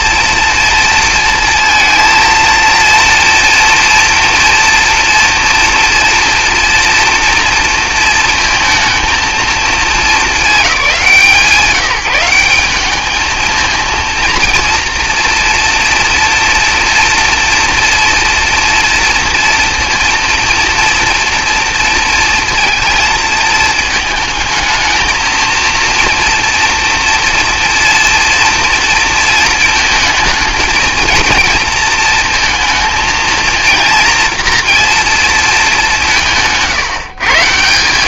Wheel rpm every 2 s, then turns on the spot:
230, 230, 230, 230, 220, 200, 200, 230, 230, 230, 230, 230, 220, 230, 230, 230, 220, 230, 150.
none